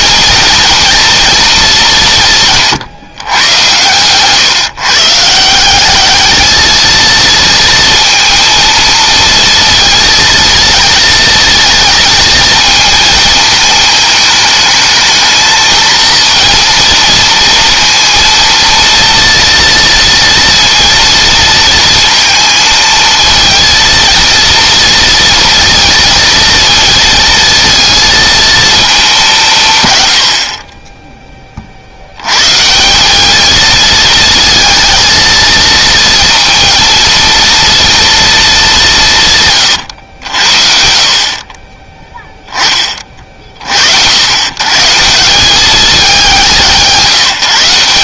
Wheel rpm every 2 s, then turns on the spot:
230, 150, 140, 220, 230, 230, 230, 220, 230, 230, 230, 230, 230, 230, 210, 20, 170, 220, 230, 180, 50, 30, 130, 170.
none